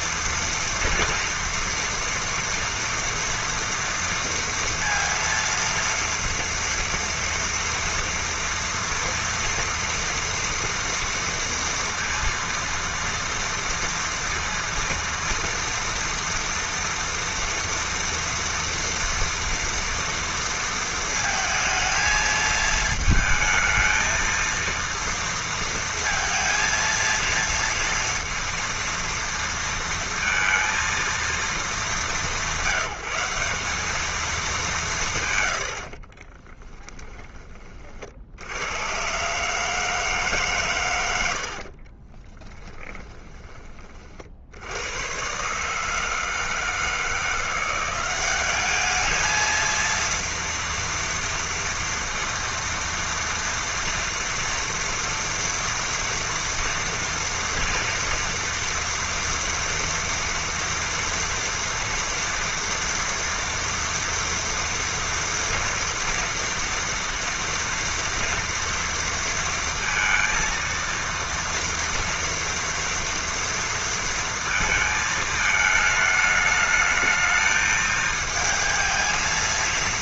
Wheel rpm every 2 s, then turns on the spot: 230, 230, 230, 230, 230, 230, 230, 240, 230, 230, 220, 220, 230, 230, 230, 230, 180, 120, 20, 130, 90, 20, 120, 170, 220, 230, 230, 230, 240, 230, 230, 230, 230, 230, 230, 230, 230, 220, 220, 230.
42-44